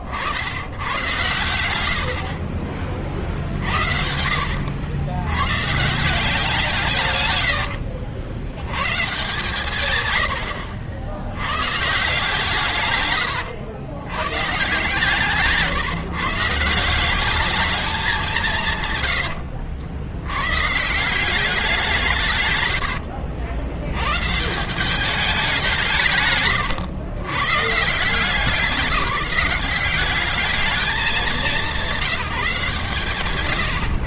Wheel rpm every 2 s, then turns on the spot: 90, 60, 70, 160, 100, 80, 150, 130, 150, 180, 130, 140, 130, 110, 180, 210, 170.
22-24 26-28